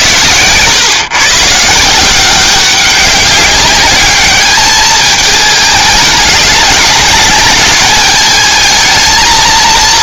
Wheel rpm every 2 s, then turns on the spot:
120, 190, 210, 200, 220.
none